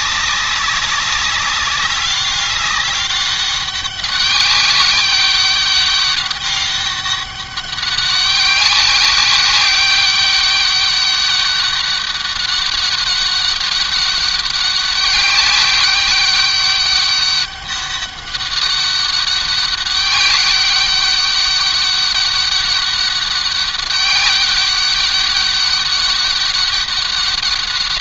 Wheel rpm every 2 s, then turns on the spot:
200, 200, 190, 200, 200, 200, 200, 200, 200, 200, 200, 200, 200, 200.
none